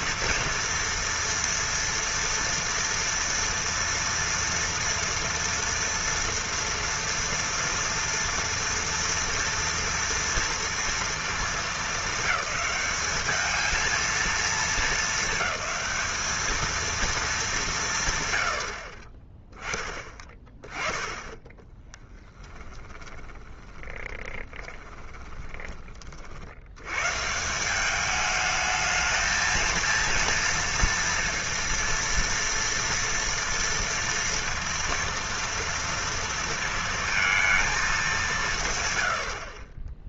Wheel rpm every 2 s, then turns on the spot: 230, 230, 230, 240, 240, 230, 210, 220, 220, 120, 20, 20, 20, 60, 210, 230, 230, 230, 230, 180.
22-26